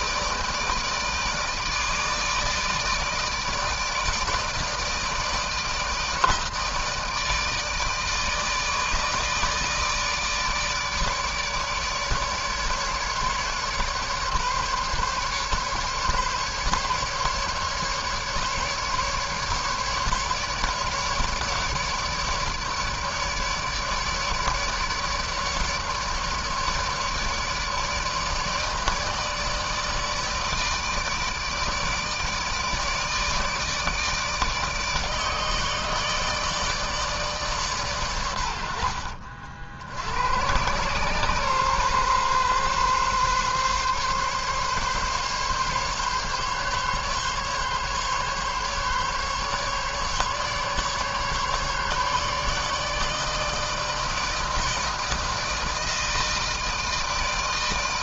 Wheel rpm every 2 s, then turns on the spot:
160, 160, 160, 160, 160, 150, 150, 140, 150, 150, 150, 150, 150, 150, 160, 160, 150, 150, 160, 100, 90, 130, 140, 140, 140, 140, 150, 160, 160.
none